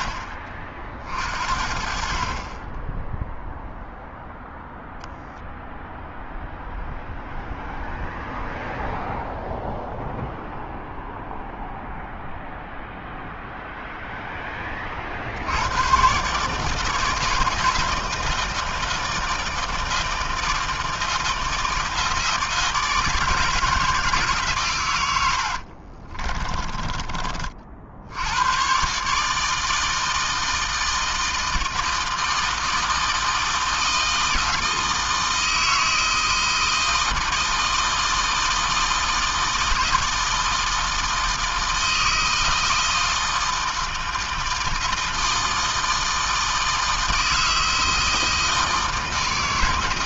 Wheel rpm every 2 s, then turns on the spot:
50, 0, 0, 0, 0, 0, 0, 60, 160, 160, 160, 160, 100, 30, 150, 160, 160, 160, 160, 160, 160, 160, 160, 160, 160.
none